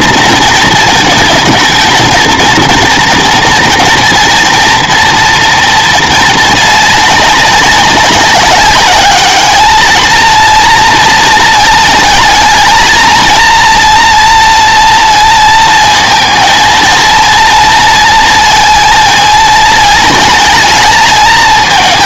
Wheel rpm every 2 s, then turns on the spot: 230, 230, 230, 220, 190, 230, 230, 230, 230, 230, 220.
none